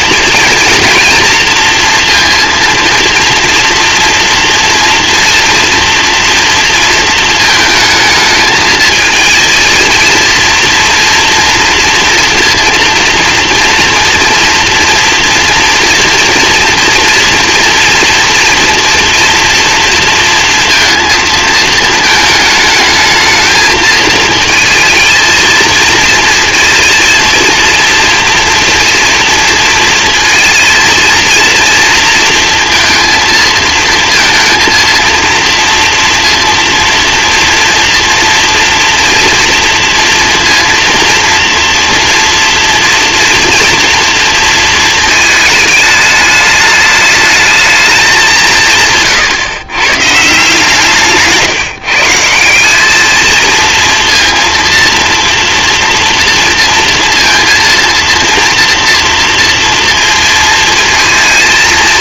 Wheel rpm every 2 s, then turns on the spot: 230, 230, 230, 230, 220, 230, 230, 230, 230, 230, 230, 220, 230, 230, 240, 230, 230, 230, 230, 240, 230, 240, 230, 210, 150, 150, 190, 230, 230, 230, 220.
none